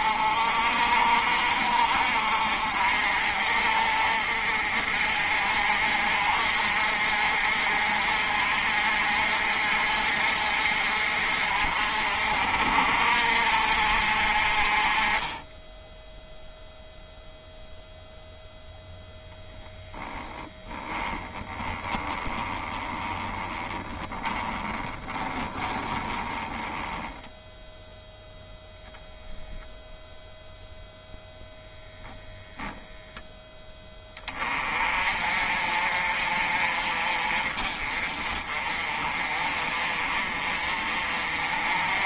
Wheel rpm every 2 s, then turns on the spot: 50, 50, 50, 50, 50, 50, 50, 30, 0, 0, 10, 20, 20, 10, 10, 0, 0, 30, 40, 40, 40.
20-28